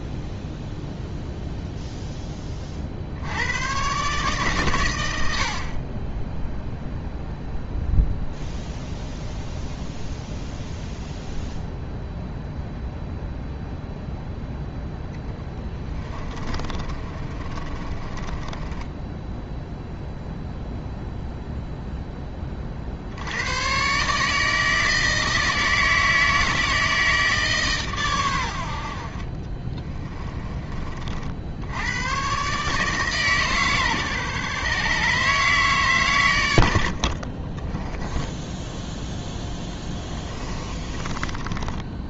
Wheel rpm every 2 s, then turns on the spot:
0, 50, 120, 0, 0, 0, 0, 0, 30, 10, 0, 50, 160, 160, 60, 40, 150, 140, 70, 0, 30.
16-20 40-42